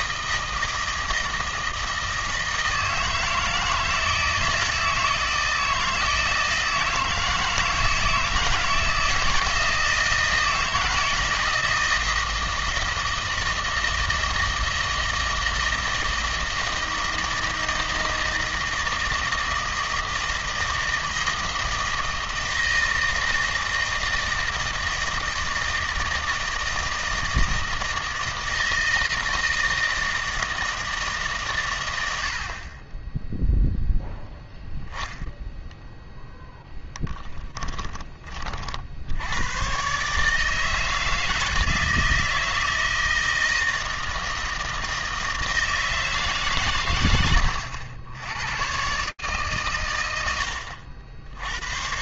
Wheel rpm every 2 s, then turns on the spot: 160, 160, 160, 160, 160, 160, 160, 160, 160, 160, 160, 160, 160, 160, 160, 160, 30, 0, 10, 50, 150, 160, 160, 110, 130, 90.
36-38